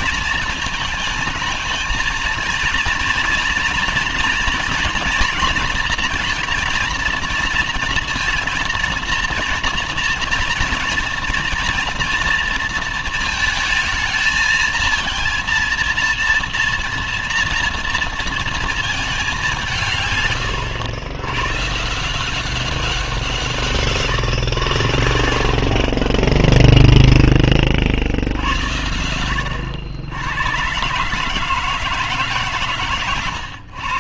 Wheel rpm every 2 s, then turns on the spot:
220, 220, 230, 230, 230, 230, 230, 220, 230, 220, 110, 180, 100, 10, 80, 110, 140.
26-28